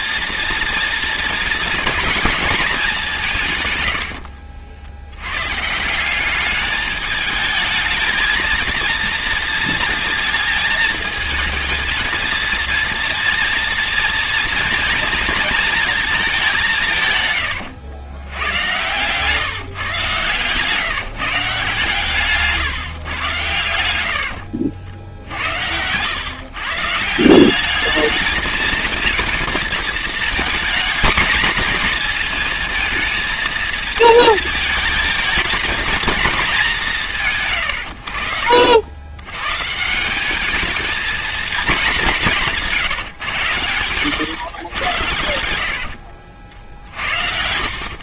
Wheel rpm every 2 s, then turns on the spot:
240, 210, 70, 210, 230, 220, 230, 230, 190, 120, 140, 150, 60, 140, 230, 220, 220, 220, 200, 70, 210, 170, 100, 60.
24-26 46-48